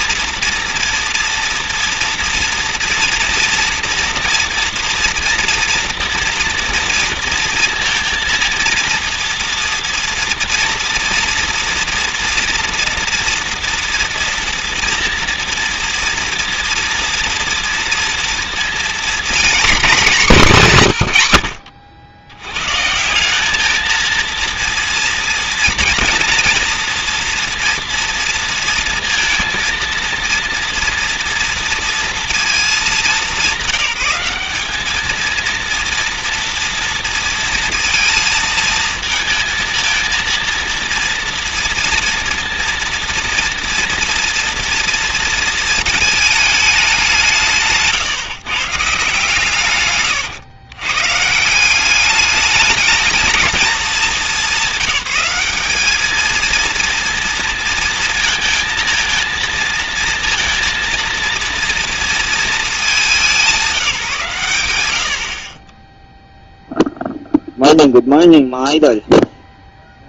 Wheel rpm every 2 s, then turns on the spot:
230, 230, 230, 230, 230, 230, 230, 230, 240, 240, 170, 110, 230, 230, 230, 230, 220, 200, 230, 230, 230, 230, 230, 210, 140, 110, 210, 200, 230, 230, 230, 220, 110, 0, 0.
none